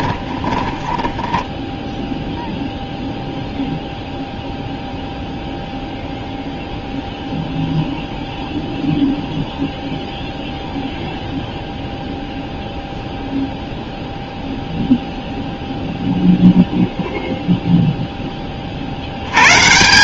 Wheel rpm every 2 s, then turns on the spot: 10, 0, 0, 0, 0, 0, 0, 0, 0, 50.
0-2